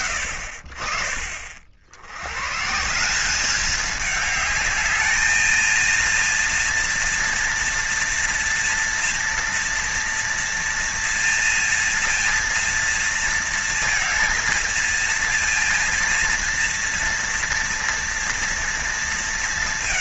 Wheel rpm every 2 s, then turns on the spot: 40, 160, 210, 230, 230, 230, 230, 230, 230, 230.
none